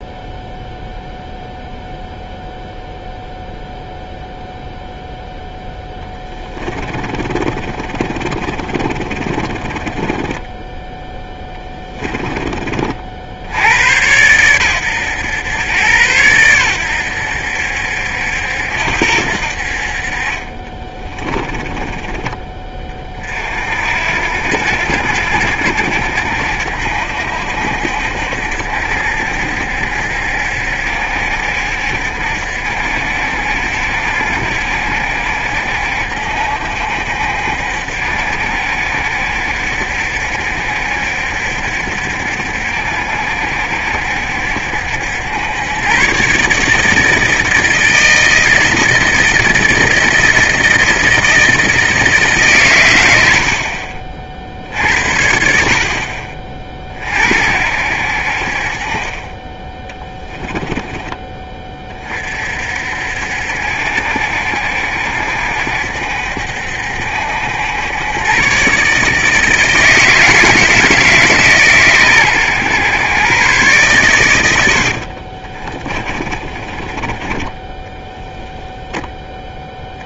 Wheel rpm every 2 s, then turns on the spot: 0, 0, 0, 20, 30, 10, 50, 110, 90, 80, 20, 30, 70, 70, 70, 70, 70, 70, 70, 70, 70, 70, 70, 160, 160, 160, 100, 70, 50, 40, 20, 60, 70, 70, 140, 160, 120, 60, 30, 0.
6-12 20-22 74-78